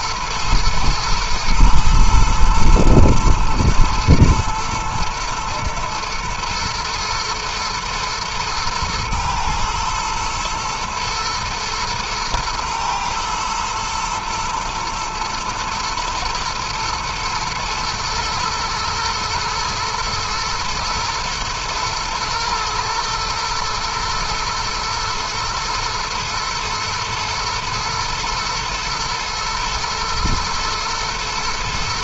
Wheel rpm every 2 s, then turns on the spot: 110, 110, 110, 110, 110, 110, 110, 120, 110, 120, 110, 110, 120, 110, 110, 120.
none